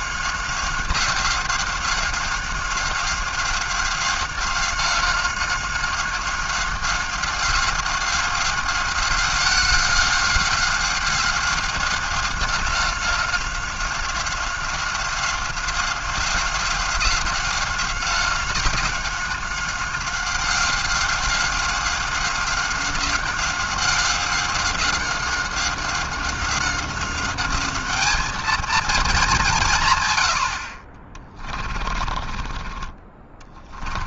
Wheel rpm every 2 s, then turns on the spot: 190, 190, 190, 190, 190, 190, 190, 190, 190, 180, 190, 190, 190, 190, 210, 140, 20.
32-34